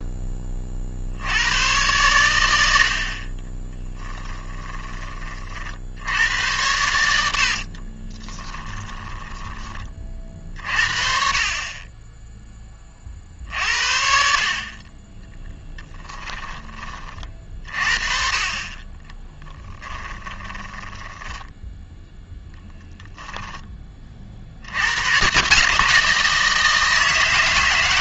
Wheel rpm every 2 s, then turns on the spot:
50, 70, 20, 90, 10, 50, 30, 30, 20, 20, 10, 0, 90, 160.
8-10 20-22